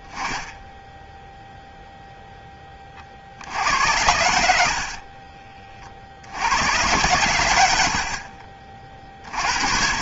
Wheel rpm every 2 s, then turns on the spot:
10, 0, 80, 80, 30.
none